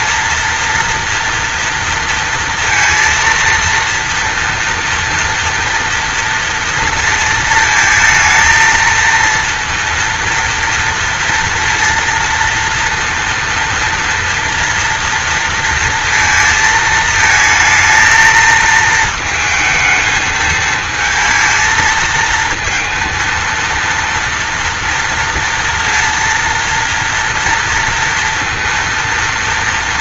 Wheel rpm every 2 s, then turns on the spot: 230, 230, 230, 230, 230, 230, 230, 230, 220, 220, 220, 230, 230, 230, 230.
none